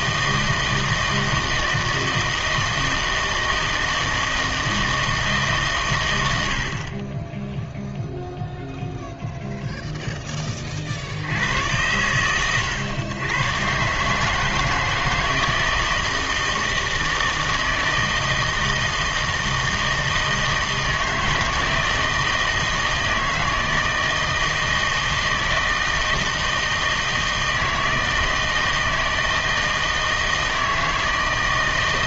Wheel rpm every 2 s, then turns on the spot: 160, 160, 160, 50, 0, 50, 110, 160, 160, 160, 160, 160, 160, 160, 160, 160.
none